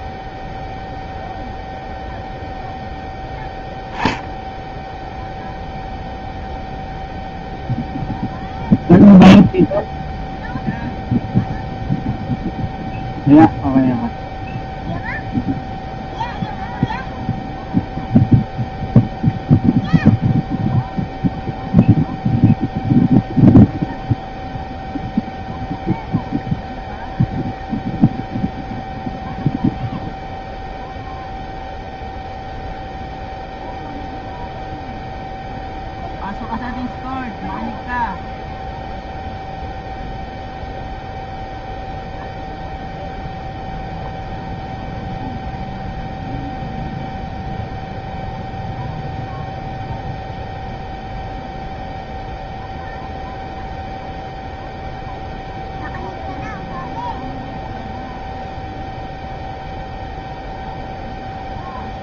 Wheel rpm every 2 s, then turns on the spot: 0, 0, 0, 0, 0, 0, 0, 0, 0, 0, 0, 0, 0, 0, 0, 0, 0, 0, 0, 0, 0, 0, 0, 0, 0, 0, 0, 0, 0, 0, 0.
none